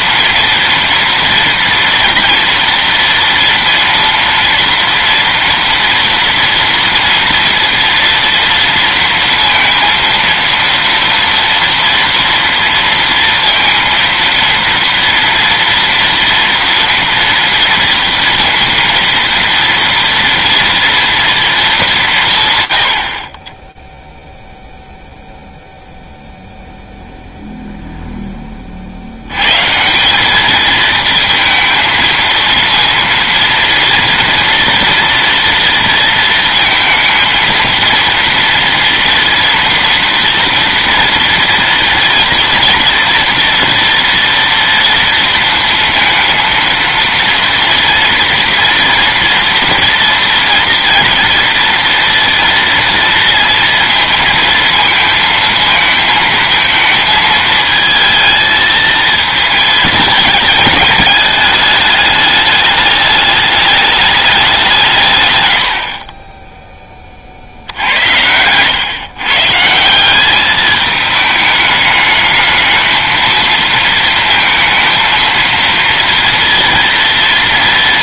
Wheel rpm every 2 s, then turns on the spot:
240, 230, 230, 230, 230, 230, 230, 230, 240, 230, 230, 90, 0, 0, 90, 220, 230, 240, 230, 230, 230, 230, 230, 230, 240, 230, 230, 220, 220, 220, 210, 210, 130, 20, 120, 210, 220, 230, 230.
none